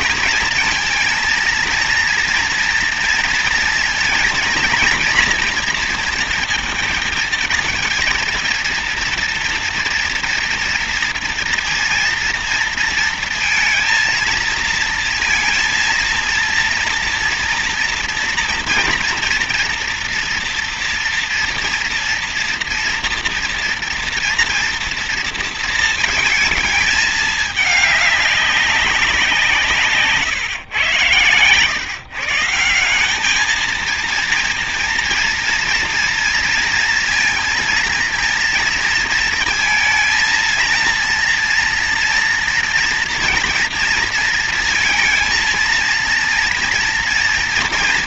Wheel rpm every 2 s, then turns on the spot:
230, 230, 230, 220, 230, 230, 230, 230, 230, 230, 230, 230, 230, 220, 190, 120, 190, 230, 230, 230, 230, 230, 230, 230.
none